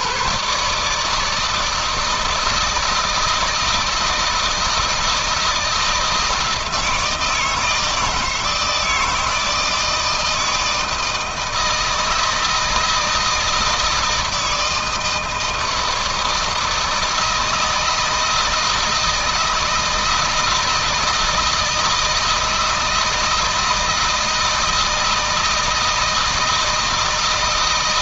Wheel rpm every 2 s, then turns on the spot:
130, 160, 160, 160, 160, 160, 160, 160, 160, 160, 160, 160, 160, 160.
none